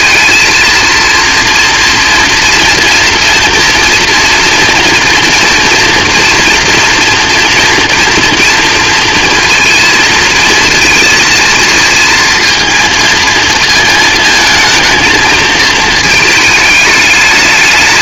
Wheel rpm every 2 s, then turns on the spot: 230, 230, 230, 230, 230, 220, 230, 220, 210.
none